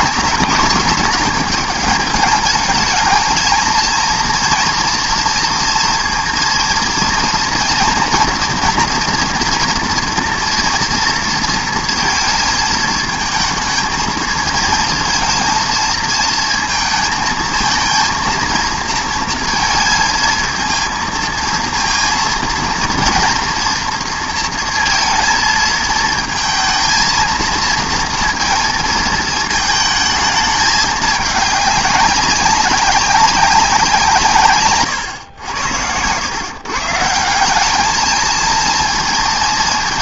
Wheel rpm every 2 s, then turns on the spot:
220, 210, 230, 230, 230, 240, 220, 220, 230, 230, 220, 230, 230, 230, 230, 210, 190, 130, 130, 230.
none